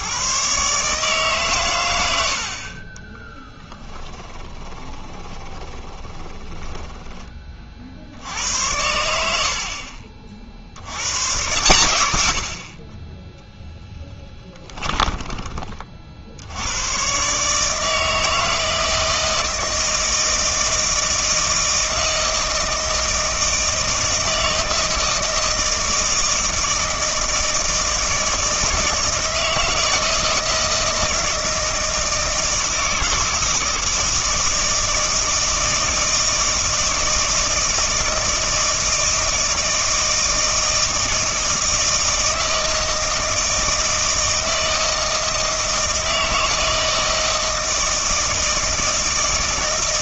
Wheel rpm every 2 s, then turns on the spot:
150, 40, 10, 20, 90, 70, 40, 10, 100, 160, 160, 160, 160, 160, 160, 160, 160, 160, 160, 160, 160, 160, 160, 160, 160.
4-8 14-16